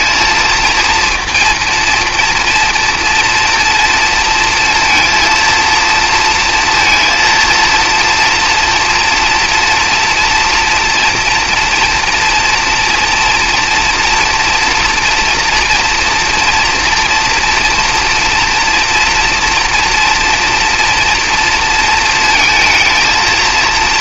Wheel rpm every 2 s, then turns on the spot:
230, 230, 230, 230, 240, 230, 240, 240, 230, 230, 240, 230.
none